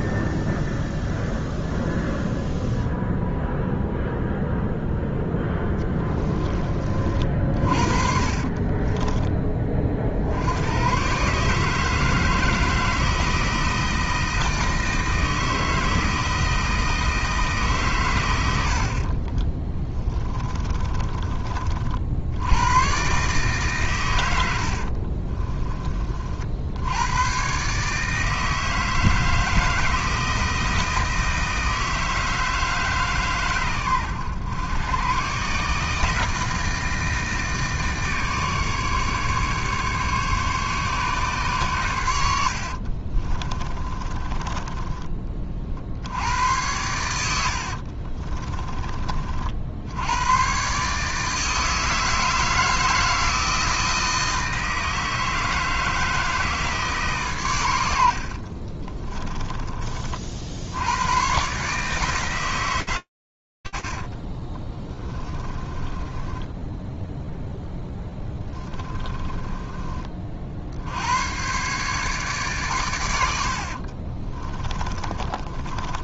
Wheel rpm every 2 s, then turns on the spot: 0, 0, 0, 40, 30, 110, 160, 160, 160, 60, 20, 110, 50, 90, 160, 160, 150, 110, 160, 150, 140, 50, 20, 90, 30, 150, 160, 160, 150, 40, 90, 150, 50, 20, 20, 70, 120, 30.
8-10 18-22 24-26 42-46 58-60 64-70 74-76